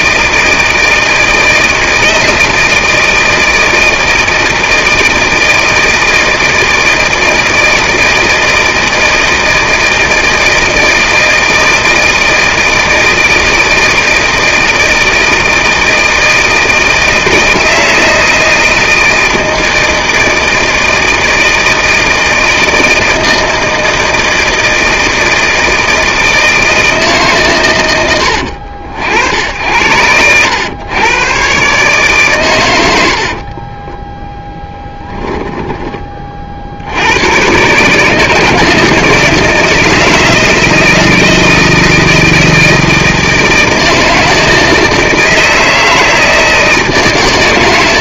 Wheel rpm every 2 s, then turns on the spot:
160, 160, 160, 160, 160, 160, 160, 160, 160, 160, 160, 160, 160, 160, 80, 100, 100, 10, 60, 160, 160, 160, 160, 160.
34-36